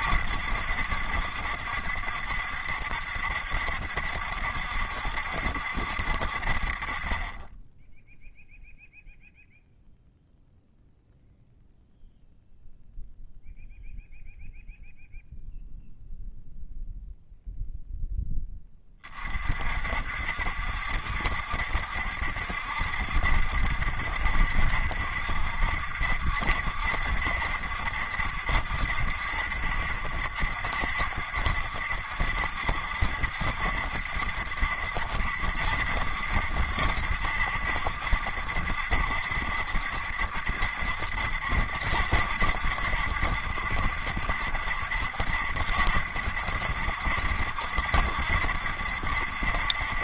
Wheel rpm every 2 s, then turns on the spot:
70, 70, 70, 50, 0, 0, 0, 0, 0, 10, 70, 70, 70, 70, 70, 70, 70, 70, 70, 70, 70, 70, 70, 70, 70.
none